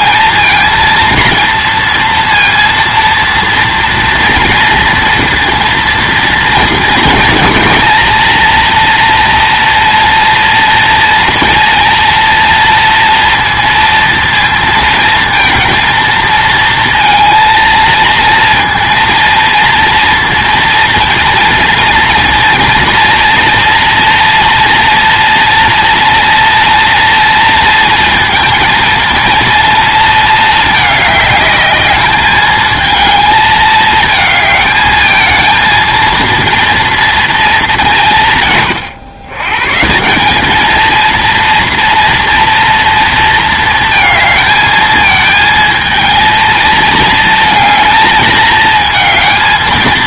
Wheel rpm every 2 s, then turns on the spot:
230, 230, 230, 230, 230, 230, 230, 230, 230, 230, 230, 240, 230, 230, 220, 210, 220, 220, 230, 130, 210, 230, 220, 220, 220.
none